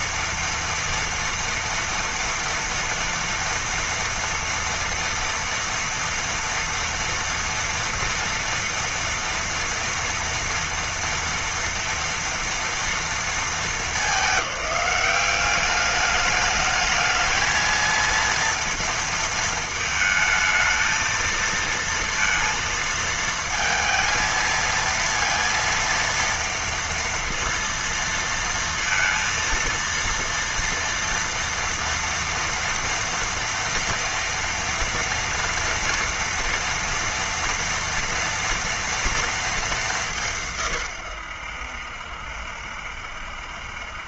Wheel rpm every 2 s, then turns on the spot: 230, 240, 230, 230, 230, 240, 230, 200, 210, 230, 220, 230, 230, 230, 230, 230, 240, 230, 230, 230, 160, 70.
none